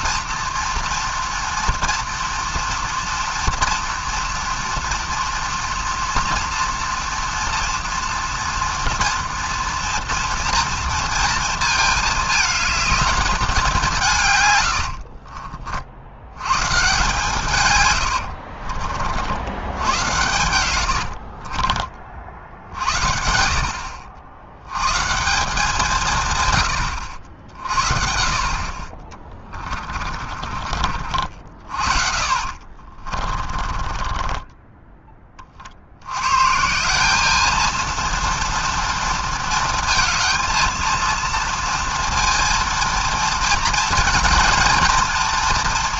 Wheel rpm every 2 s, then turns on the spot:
230, 230, 230, 230, 230, 230, 220, 100, 120, 60, 100, 70, 120, 110, 30, 40, 40, 20, 170, 240, 230, 230, 230.
18-22 32-36